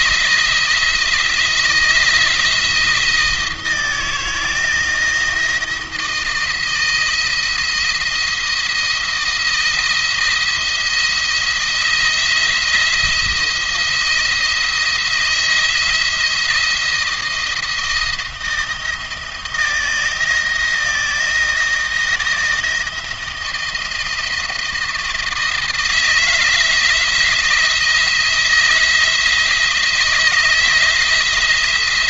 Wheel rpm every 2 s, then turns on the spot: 170, 170, 160, 160, 170, 170, 170, 170, 170, 160, 160, 170, 170, 170, 170, 160.
none